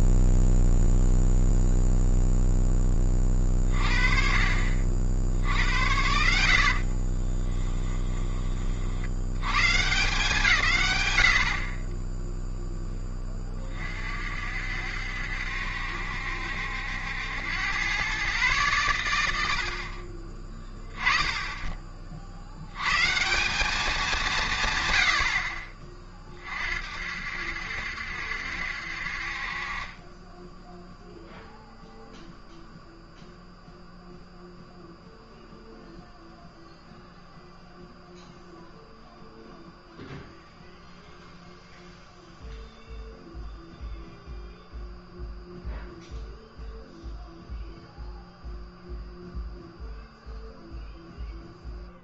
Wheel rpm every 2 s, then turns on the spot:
0, 10, 50, 60, 30, 160, 10, 60, 70, 120, 10, 90, 160, 50, 60, 10, 0, 0, 0, 0, 0, 0, 0, 0, 0, 0.
6-8